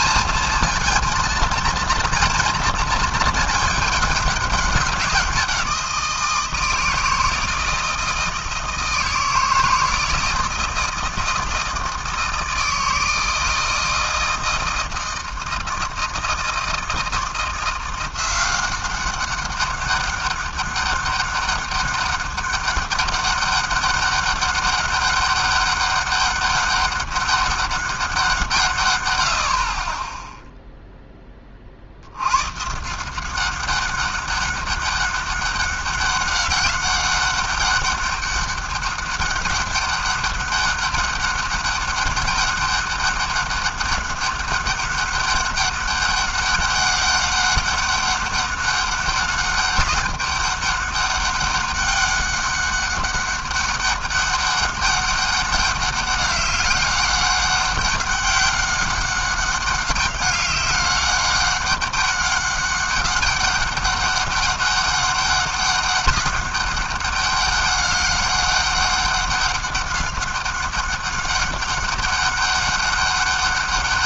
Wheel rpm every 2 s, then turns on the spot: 230, 230, 190, 160, 160, 160, 160, 160, 160, 190, 200, 200, 200, 200, 140, 0, 150, 200, 200, 200, 200, 200, 200, 200, 190, 200, 200, 200, 200, 200, 200, 200, 200, 200, 200, 200, 200.
none